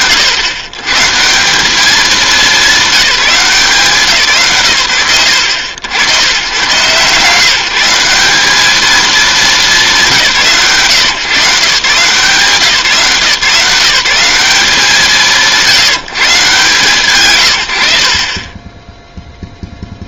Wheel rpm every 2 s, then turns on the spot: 140, 190, 100, 150, 210, 130, 170, 160, 140, 10.
none